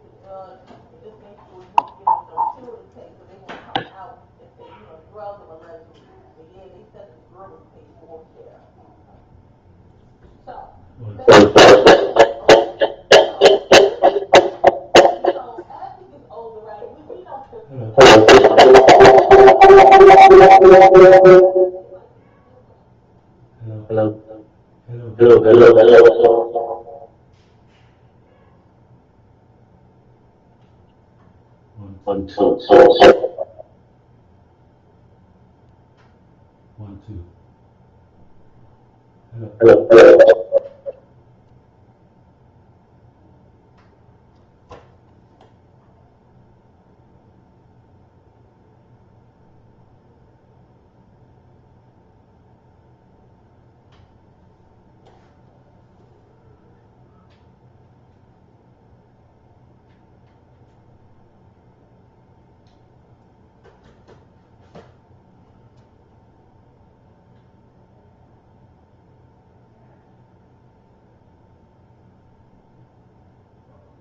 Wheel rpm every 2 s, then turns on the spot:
0, 0, 0, 0, 0, 0, 0, 0, 0, 0, 0, 0, 0, 0, 0, 0, 0, 0, 0, 0, 0, 0, 0, 0, 0, 0, 0, 0, 0, 0, 0, 0, 0, 0, 0, 0, 0.
none